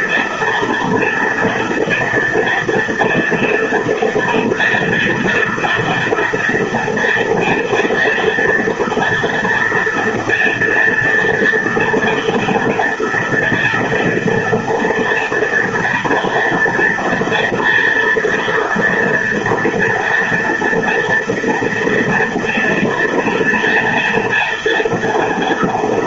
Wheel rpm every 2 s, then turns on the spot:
230, 230, 230, 230, 230, 230, 240, 230, 230, 230, 230, 230, 230.
none